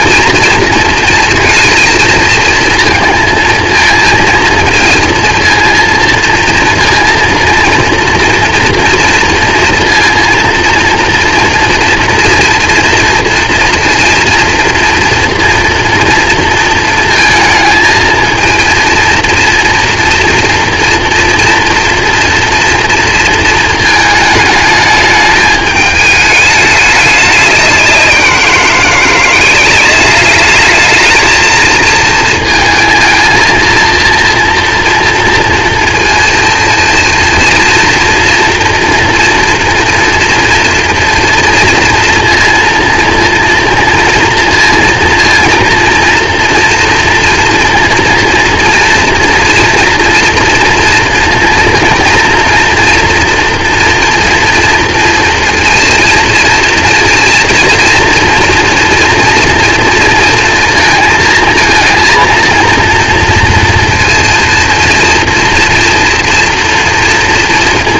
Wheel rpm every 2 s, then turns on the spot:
230, 230, 230, 230, 230, 230, 230, 230, 230, 230, 240, 240, 220, 210, 180, 200, 220, 230, 230, 230, 230, 230, 230, 240, 230, 230, 230, 230, 230, 240, 230, 230, 230, 230.
none